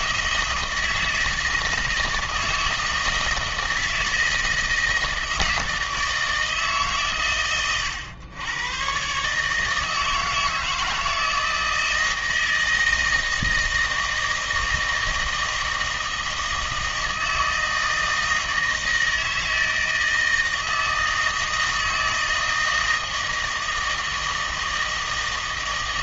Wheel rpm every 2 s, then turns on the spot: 160, 160, 160, 150, 110, 160, 160, 160, 160, 160, 160, 160, 160.
none